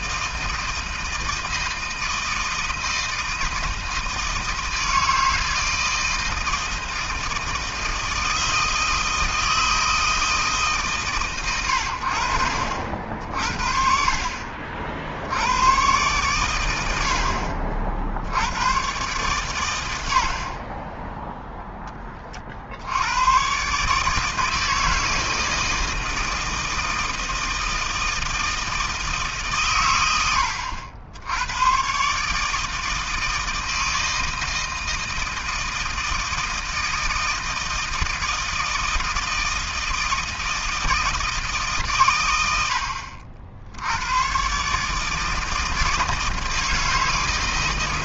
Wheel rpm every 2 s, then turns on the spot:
160, 160, 160, 160, 160, 140, 60, 50, 90, 110, 30, 70, 160, 160, 160, 90, 160, 160, 160, 160, 160, 80, 140, 160.
none